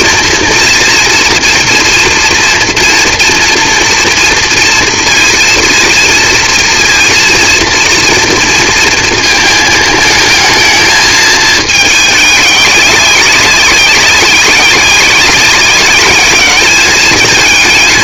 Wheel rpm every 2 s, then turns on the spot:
230, 240, 230, 230, 230, 220, 200, 190, 210.
none